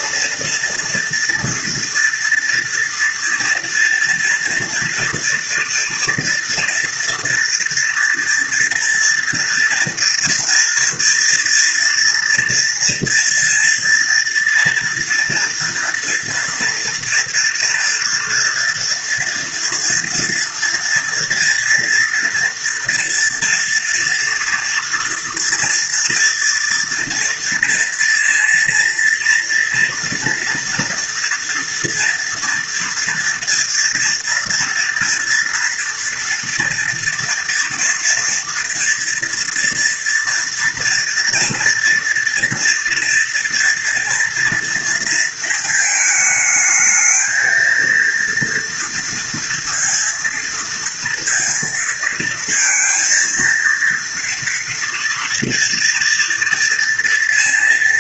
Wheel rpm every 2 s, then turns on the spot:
230, 230, 230, 230, 230, 230, 230, 230, 230, 240, 230, 230, 230, 230, 230, 230, 230, 230, 240, 230, 230, 230, 220, 220, 230, 230, 230, 230, 230.
none